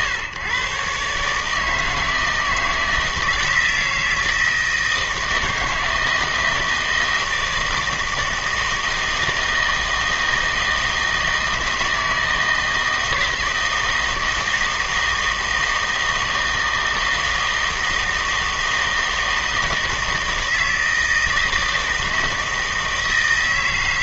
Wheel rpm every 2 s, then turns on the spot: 130, 160, 160, 160, 160, 160, 160, 160, 160, 160, 160, 160.
none